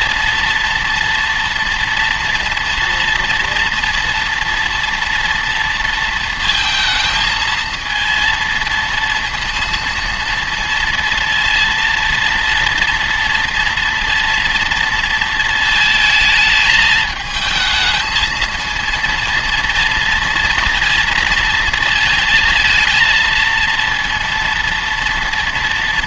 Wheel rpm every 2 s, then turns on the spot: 230, 230, 230, 230, 230, 230, 230, 230, 220, 230, 230, 230, 230.
none